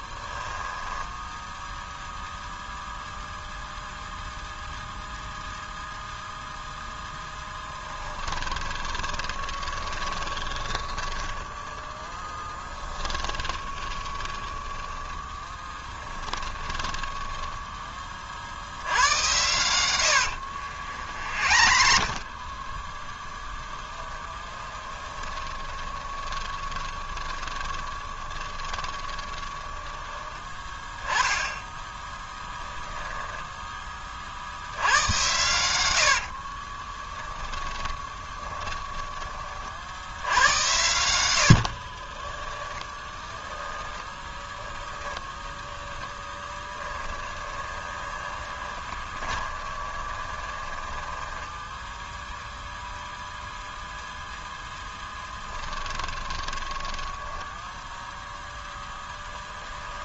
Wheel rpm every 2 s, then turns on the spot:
10, 0, 0, 0, 20, 10, 10, 20, 20, 70, 70, 20, 10, 20, 20, 10, 10, 80, 30, 10, 90, 10, 10, 10, 30, 10, 0, 10, 20, 0.
0-2 8-18 20-22 24-30 32-34 36-40 42-52 56-58